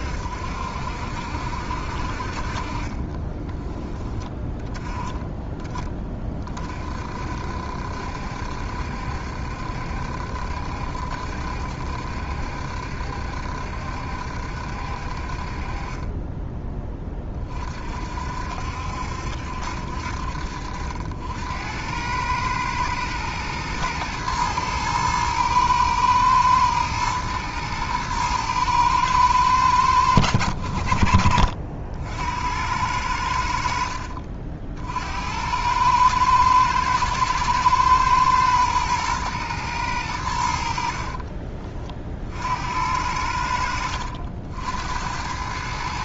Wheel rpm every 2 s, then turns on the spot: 60, 40, 20, 40, 70, 70, 70, 60, 20, 60, 60, 110, 110, 110, 110, 70, 90, 60, 110, 120, 70, 70, 80.
none